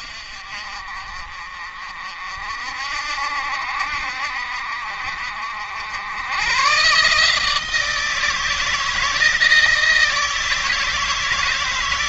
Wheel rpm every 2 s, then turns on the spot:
50, 60, 50, 120, 160, 160.
none